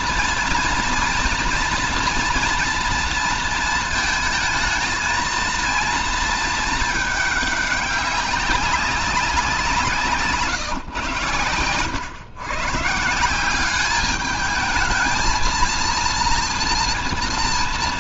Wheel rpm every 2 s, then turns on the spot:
230, 230, 220, 220, 190, 130, 140, 220, 230.
none